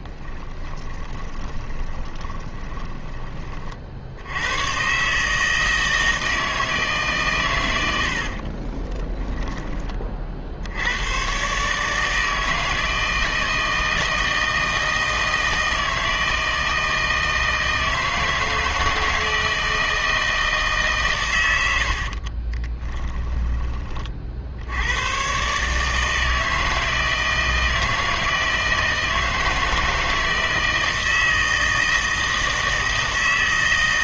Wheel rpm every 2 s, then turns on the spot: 10, 20, 110, 160, 30, 70, 160, 160, 160, 160, 150, 30, 70, 160, 160, 160, 160.
0-4 8-10 22-24